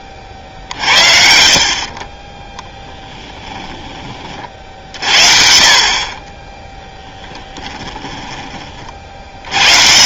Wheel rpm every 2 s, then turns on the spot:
50, 10, 50, 10, 20.
2-4 6-8